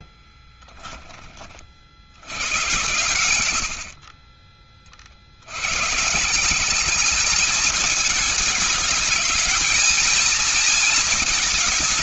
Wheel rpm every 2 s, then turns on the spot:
10, 100, 50, 200, 220, 230.
none